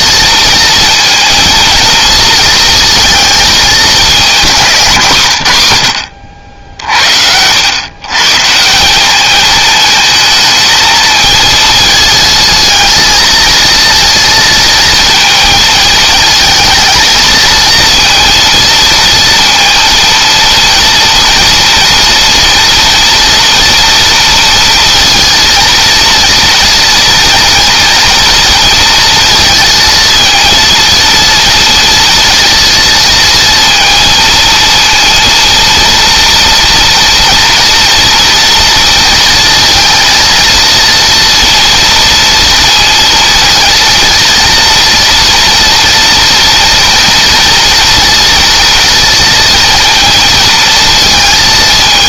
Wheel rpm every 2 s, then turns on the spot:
230, 220, 140, 70, 200, 220, 230, 230, 220, 230, 230, 240, 230, 230, 230, 230, 230, 230, 230, 230, 230, 230, 230, 230, 230, 220.
none